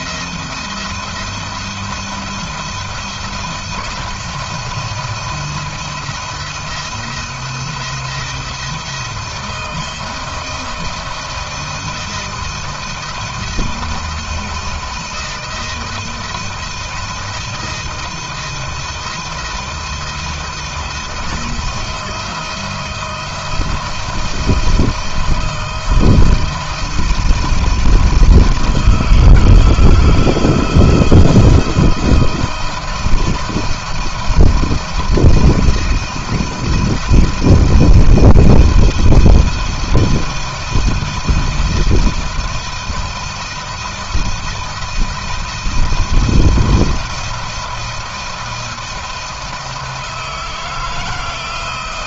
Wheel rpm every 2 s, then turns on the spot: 170, 170, 170, 160, 160, 160, 170, 170, 170, 160, 160, 170, 170, 160, 160, 160, 170, 170, 170, 160, 160, 170, 170, 170, 160, 160.
none